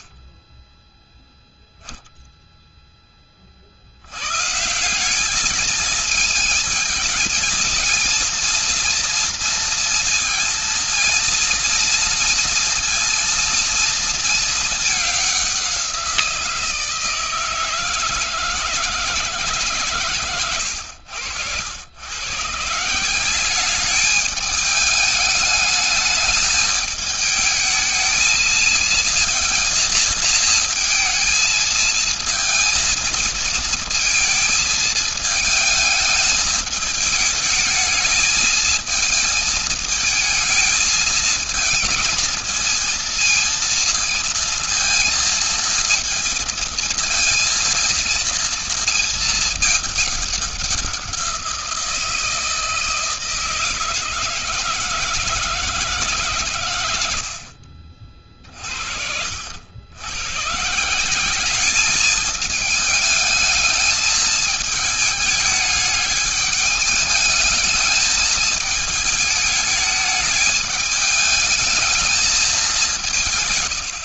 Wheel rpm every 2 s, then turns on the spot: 0, 50, 220, 220, 230, 230, 230, 190, 160, 150, 90, 190, 210, 220, 220, 220, 230, 220, 210, 220, 220, 230, 230, 230, 210, 170, 160, 160, 60, 70, 190, 210, 210, 210, 220, 210, 180.
none